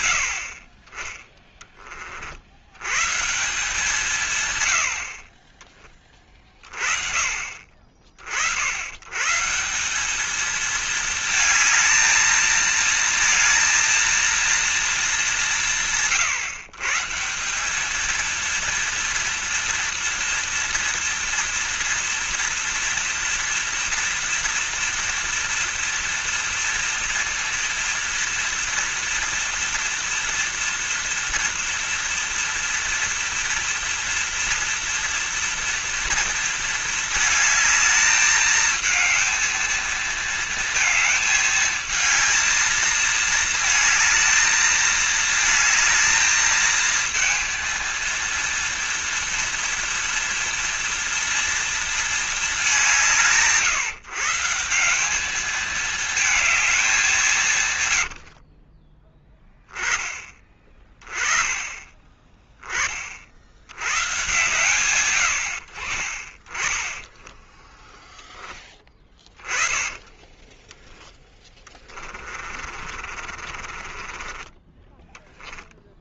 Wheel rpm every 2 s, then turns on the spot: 30, 90, 90, 30, 90, 220, 230, 230, 140, 230, 230, 230, 230, 230, 230, 230, 230, 230, 220, 220, 220, 220, 220, 220, 230, 230, 190, 180, 210, 30, 20, 30, 120, 10, 10, 10, 40, 20.
58-60 70-74